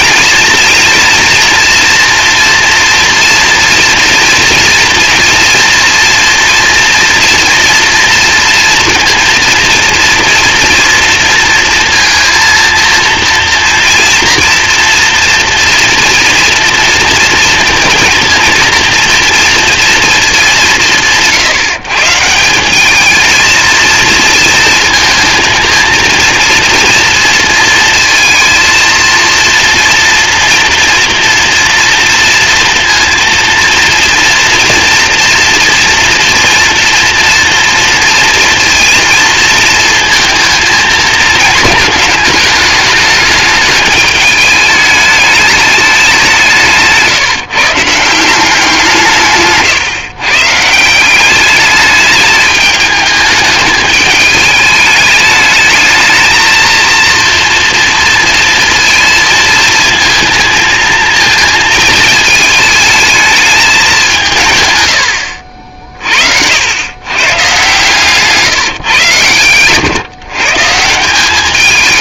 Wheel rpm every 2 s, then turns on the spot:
230, 230, 230, 230, 230, 230, 230, 230, 230, 230, 180, 210, 230, 230, 230, 230, 230, 240, 230, 230, 230, 210, 210, 150, 170, 170, 210, 210, 230, 230, 230, 220, 120, 100, 140, 170.
64-66